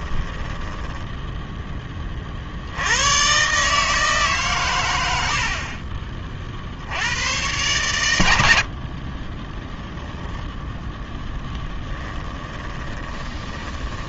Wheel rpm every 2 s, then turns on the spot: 10, 80, 110, 80, 50, 10, 20.
0-2 8-10 12-14